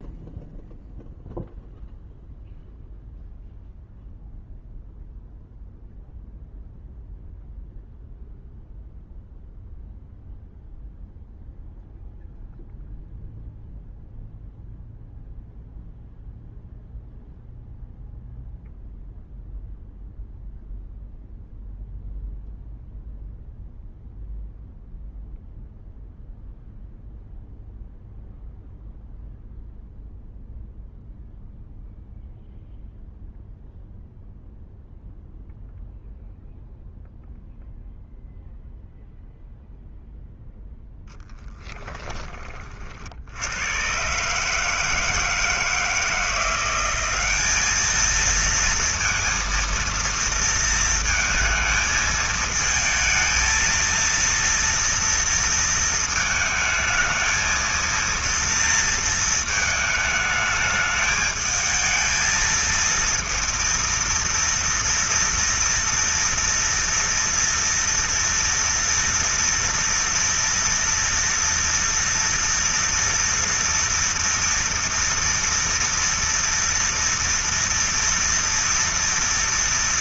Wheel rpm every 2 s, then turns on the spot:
0, 0, 0, 0, 0, 0, 0, 0, 0, 0, 0, 0, 0, 0, 0, 0, 0, 0, 0, 0, 10, 60, 160, 190, 230, 220, 220, 230, 220, 220, 210, 230, 230, 230, 230, 230, 230, 230, 230, 230.
40-42